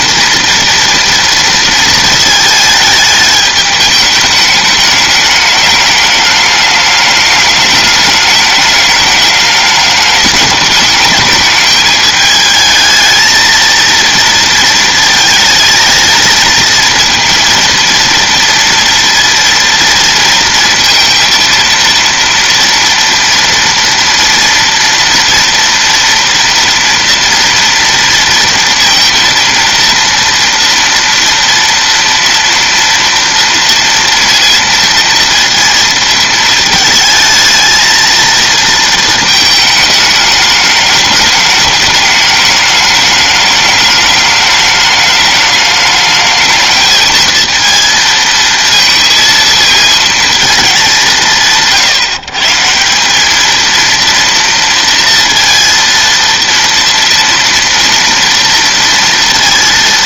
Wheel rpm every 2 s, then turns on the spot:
240, 210, 210, 210, 210, 210, 220, 230, 230, 230, 230, 230, 230, 230, 230, 230, 230, 230, 220, 230, 210, 210, 220, 220, 220, 210, 170, 230, 230, 230.
none